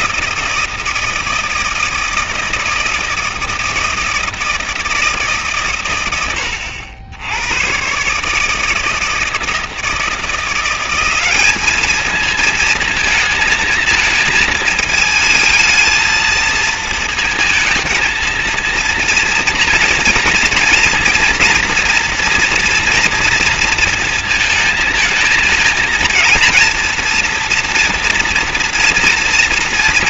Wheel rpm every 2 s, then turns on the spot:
160, 160, 160, 80, 160, 190, 230, 220, 230, 230, 230, 230, 220, 230, 240.
none